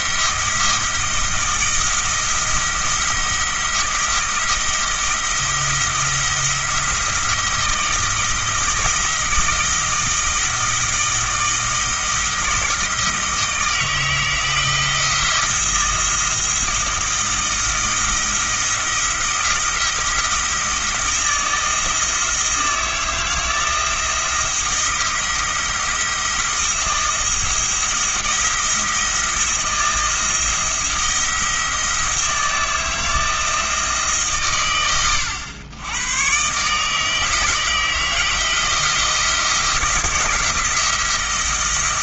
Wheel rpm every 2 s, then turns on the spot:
170, 170, 170, 170, 160, 160, 160, 160, 170, 170, 160, 160, 170, 170, 170, 170, 160, 70, 150, 170, 170.
none